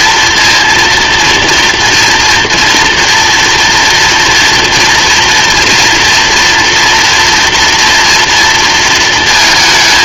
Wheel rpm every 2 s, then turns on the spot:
230, 230, 240, 240, 230.
none